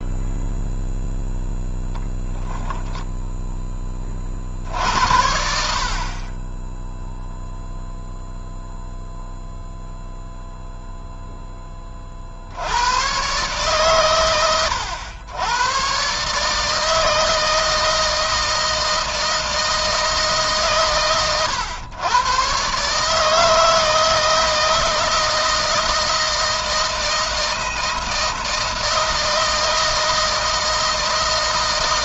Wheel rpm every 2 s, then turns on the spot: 0, 10, 80, 10, 0, 0, 110, 100, 160, 160, 140, 140, 160, 160, 160, 160.
2-4